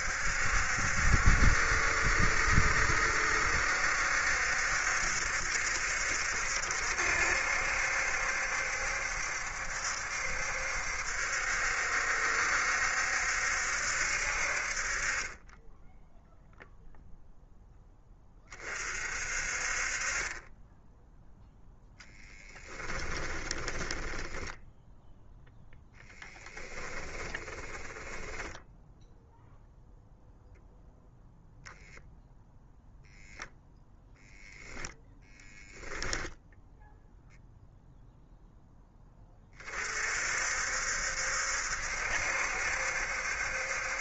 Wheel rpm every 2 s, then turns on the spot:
70, 70, 60, 70, 70, 70, 70, 40, 0, 50, 0, 20, 0, 10, 0, 0, 0, 0, 0, 10, 60, 70.
22-24 26-28